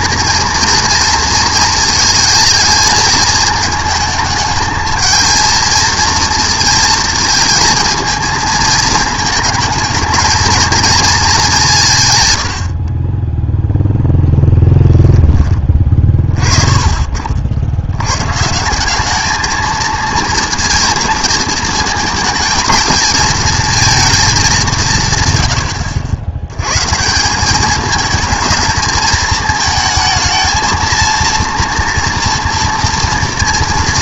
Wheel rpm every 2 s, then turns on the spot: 230, 220, 220, 230, 220, 230, 70, 10, 30, 160, 230, 220, 180, 110, 220, 230, 230.
none